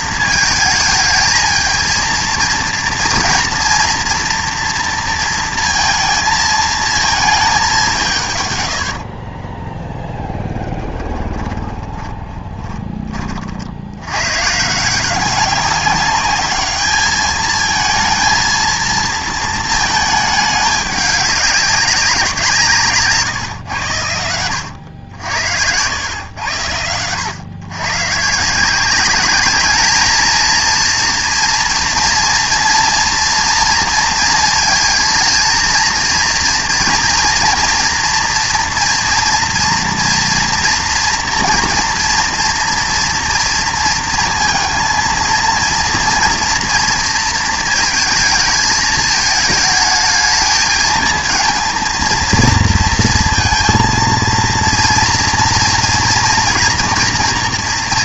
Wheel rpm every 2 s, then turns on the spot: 220, 230, 230, 220, 100, 10, 40, 140, 210, 220, 210, 170, 90, 90, 170, 230, 230, 230, 230, 230, 240, 230, 230, 230, 220, 220, 230, 230, 240.
10-14 24-26